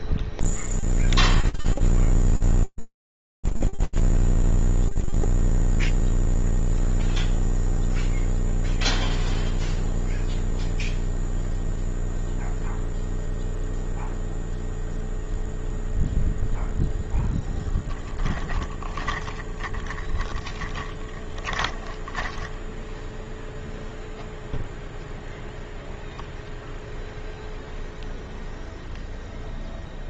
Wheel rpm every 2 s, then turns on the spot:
0, 0, 0, 0, 0, 0, 0, 0, 20, 20, 20, 0, 0, 0, 0.
16-22